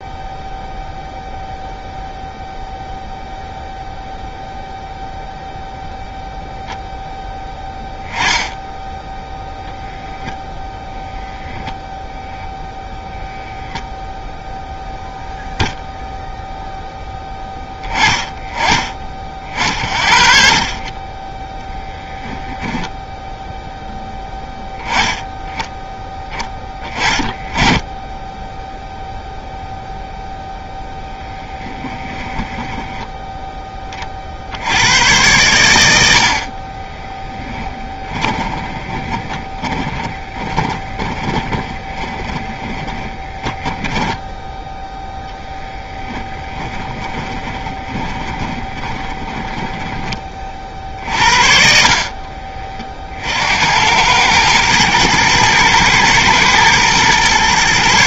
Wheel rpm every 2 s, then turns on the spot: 0, 0, 0, 0, 10, 0, 0, 0, 0, 30, 30, 10, 10, 10, 0, 0, 10, 100, 20, 20, 20, 20, 10, 20, 20, 60, 40, 110, 120.
36-44 46-50